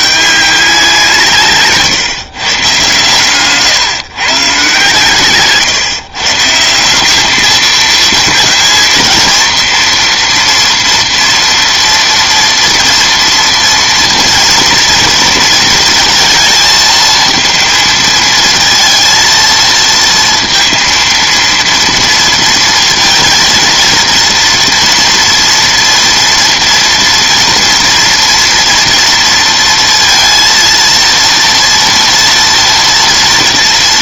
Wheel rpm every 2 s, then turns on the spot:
190, 130, 130, 160, 230, 230, 230, 230, 230, 230, 230, 230, 230, 240, 230, 230, 230.
none